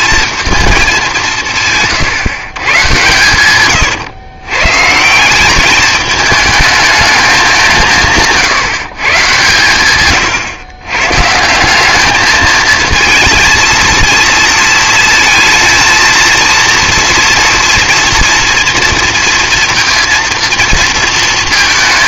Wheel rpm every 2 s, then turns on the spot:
220, 130, 140, 220, 140, 120, 220, 230, 230, 230, 230.
none